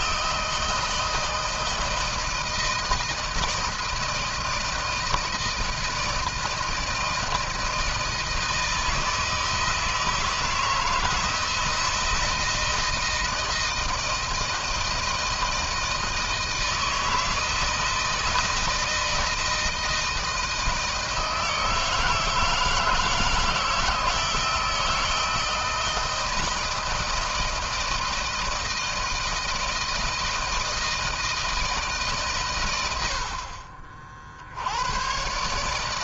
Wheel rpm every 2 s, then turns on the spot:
160, 160, 160, 160, 160, 160, 160, 160, 160, 160, 160, 160, 160, 160, 160, 160, 100, 90.
none